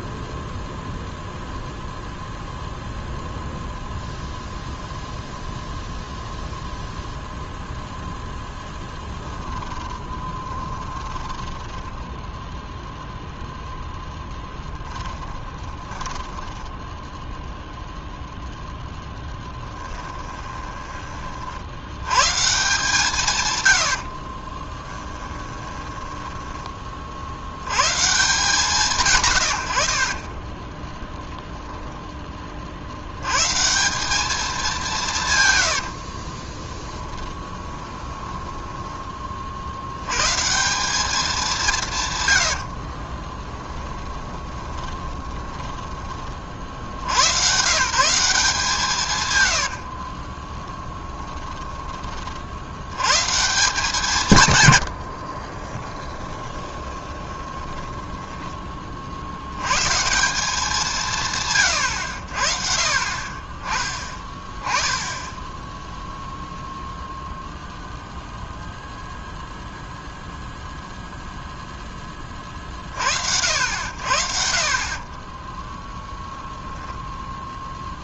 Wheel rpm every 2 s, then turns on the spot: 0, 0, 0, 0, 0, 20, 0, 0, 10, 0, 10, 150, 40, 10, 150, 20, 30, 200, 20, 10, 160, 90, 20, 60, 180, 20, 50, 130, 20, 20, 190, 60, 20, 0, 0, 0, 30, 50, 10.
10-12 16-18 20-22 24-26 30-32 36-40 42-46 50-52 56-58 76-78